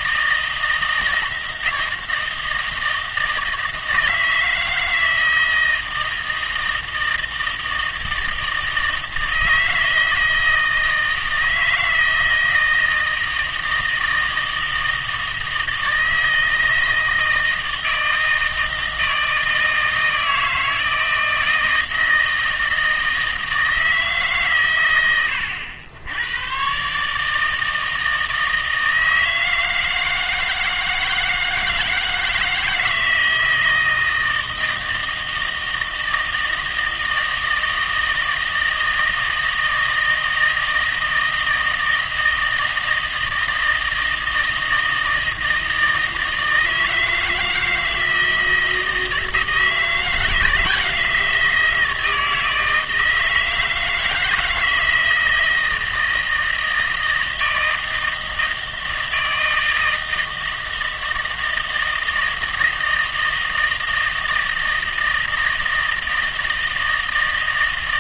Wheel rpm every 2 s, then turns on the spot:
160, 160, 160, 160, 160, 160, 160, 160, 160, 160, 160, 160, 110, 130, 160, 160, 160, 160, 160, 160, 160, 160, 160, 160, 160, 160, 160, 160, 160, 160, 160, 160, 160, 160.
none